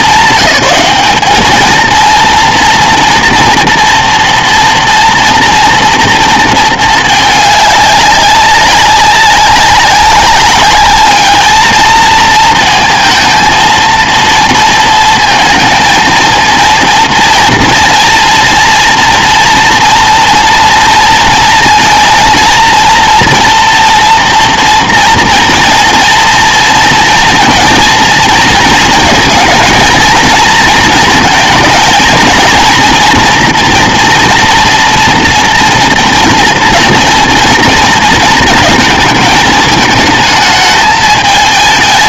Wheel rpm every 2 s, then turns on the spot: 200, 230, 230, 220, 190, 200, 220, 230, 230, 230, 230, 230, 230, 230, 220, 220, 230, 240, 230, 220, 220.
none